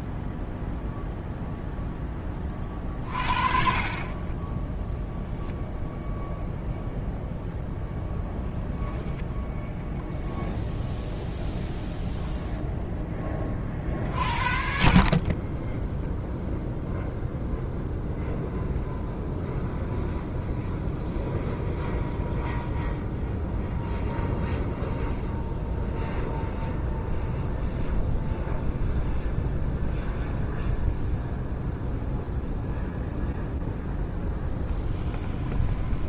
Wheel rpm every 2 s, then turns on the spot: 0, 30, 10, 0, 0, 0, 0, 50, 0, 0, 0, 0, 0, 0, 0, 0, 0, 10.
34-36